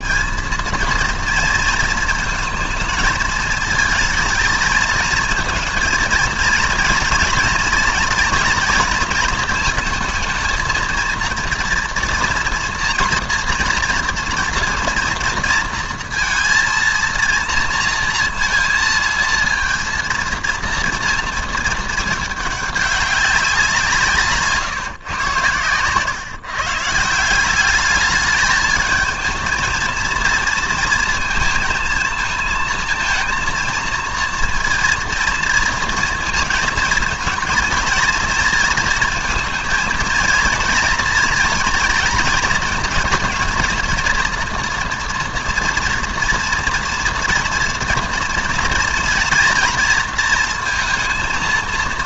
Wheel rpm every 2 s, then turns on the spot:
220, 220, 220, 230, 240, 220, 230, 230, 230, 230, 230, 210, 140, 150, 210, 230, 220, 230, 230, 230, 230, 230, 230, 230, 240, 230.
none